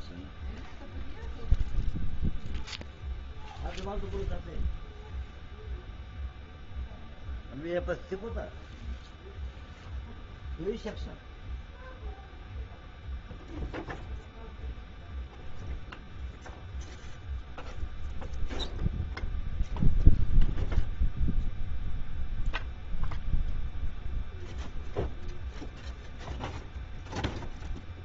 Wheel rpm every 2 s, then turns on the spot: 0, 0, 0, 0, 0, 0, 0, 0, 0, 0, 0, 0, 0, 0.
none